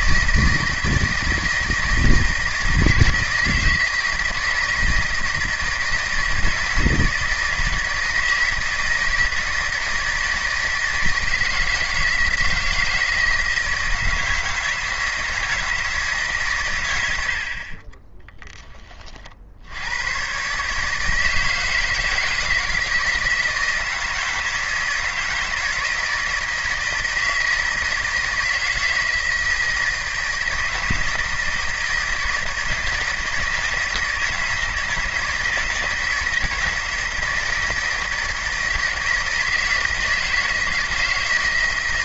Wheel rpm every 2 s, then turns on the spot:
160, 160, 170, 160, 160, 160, 160, 160, 110, 30, 160, 160, 160, 160, 160, 160, 160, 160, 160, 160, 160.
none